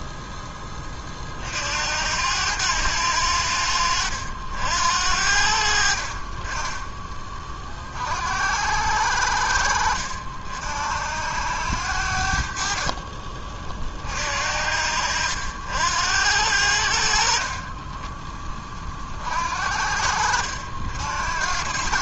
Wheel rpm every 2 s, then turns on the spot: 10, 90, 70, 20, 70, 70, 50, 60, 80, 20, 70.
12-14